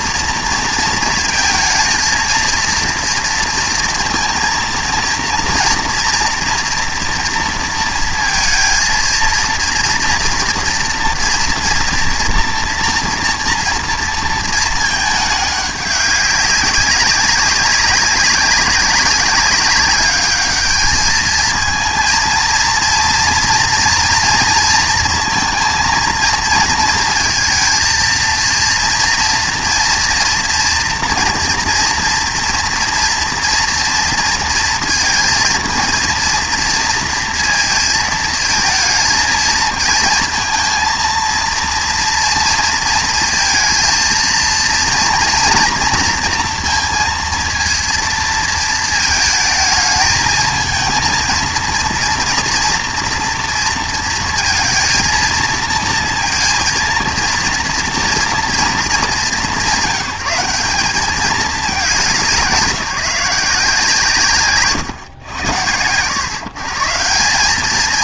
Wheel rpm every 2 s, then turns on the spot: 230, 230, 230, 230, 230, 230, 240, 220, 190, 190, 210, 230, 230, 220, 230, 240, 240, 230, 230, 230, 230, 230, 230, 230, 220, 220, 230, 230, 230, 220, 190, 170, 120, 150.
none